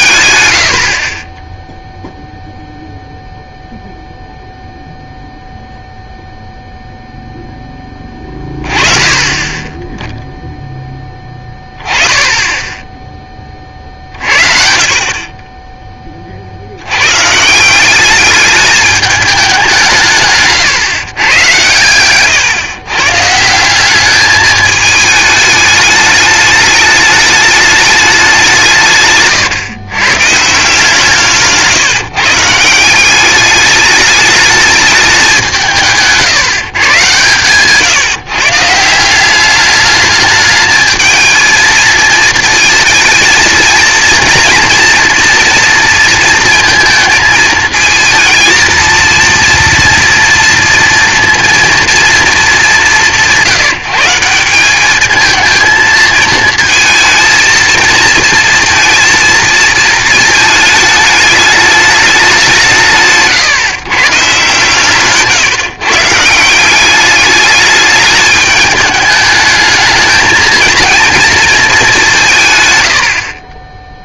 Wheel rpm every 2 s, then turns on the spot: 110, 0, 0, 0, 20, 0, 20, 60, 40, 210, 140, 120, 210, 210, 180, 150, 160, 210, 140, 140, 210, 220, 230, 230, 220, 230, 220, 180, 220, 230, 220, 190, 130, 160, 210, 220, 150.
20-22